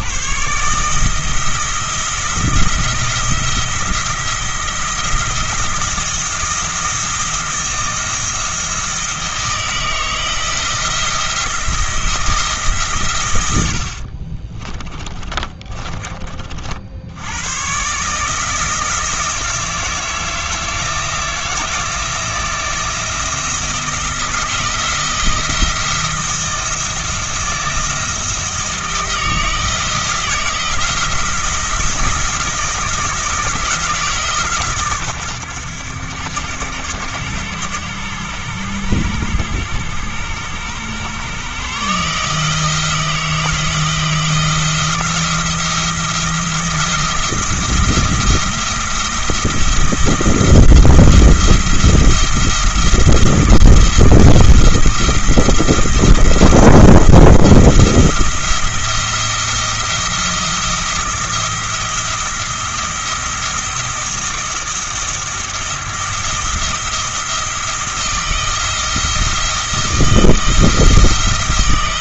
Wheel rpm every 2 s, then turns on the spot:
150, 170, 170, 170, 160, 170, 150, 30, 50, 160, 160, 170, 170, 170, 160, 160, 170, 140, 100, 100, 100, 160, 170, 170, 170, 170, 170, 170, 170, 170, 170, 170, 170, 170, 160, 170.
14-16